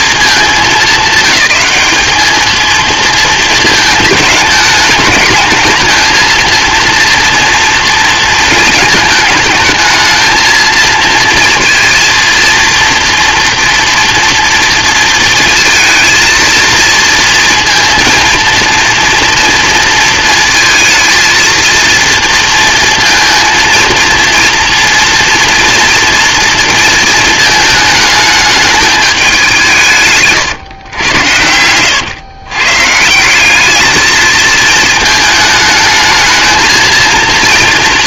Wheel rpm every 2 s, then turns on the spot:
200, 230, 210, 230, 220, 230, 240, 230, 230, 230, 220, 230, 230, 230, 210, 110, 150, 220, 230.
none